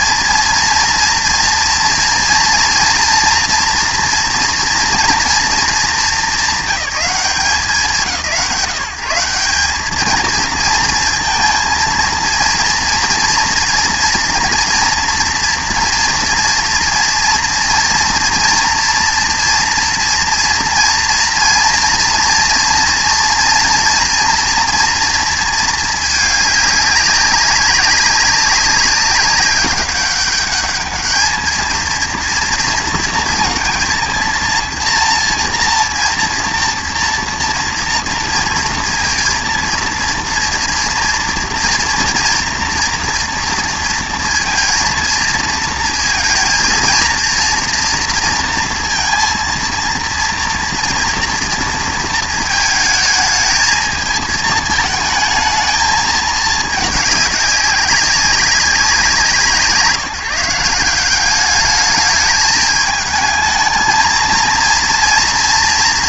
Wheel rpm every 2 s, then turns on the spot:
230, 240, 240, 200, 170, 230, 230, 240, 230, 230, 230, 230, 230, 200, 200, 210, 230, 230, 230, 230, 230, 230, 230, 230, 230, 240, 220, 220, 210, 190, 170, 210, 230.
none